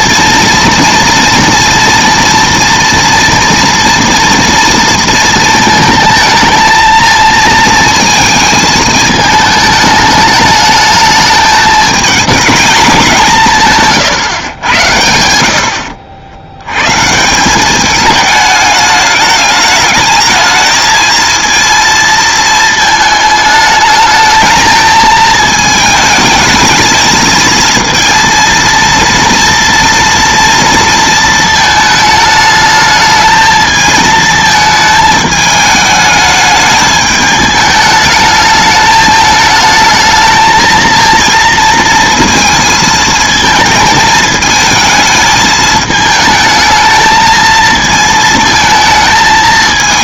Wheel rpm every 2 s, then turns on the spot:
230, 230, 230, 220, 220, 210, 210, 110, 100, 210, 220, 220, 220, 220, 230, 230, 210, 220, 210, 210, 220, 220, 220, 220, 220.
none